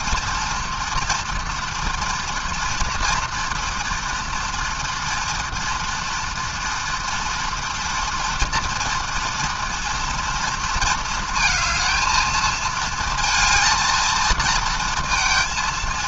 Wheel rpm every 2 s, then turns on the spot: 230, 230, 230, 230, 230, 230, 220, 230.
none